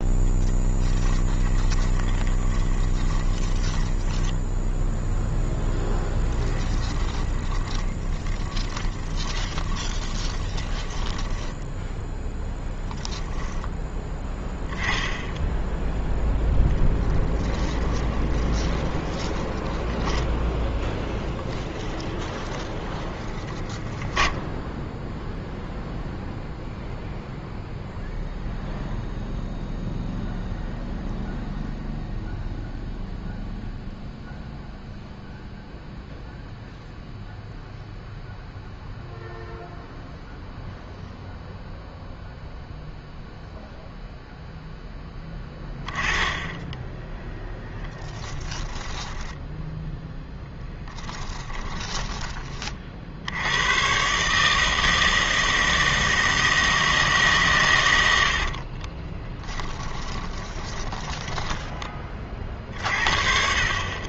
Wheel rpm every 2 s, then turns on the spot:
10, 20, 10, 10, 20, 20, 0, 10, 10, 20, 0, 10, 0, 0, 0, 0, 0, 0, 0, 0, 0, 0, 0, 10, 10, 10, 50, 160, 160, 30, 20, 40.
0-12 16-20 48-52 58-62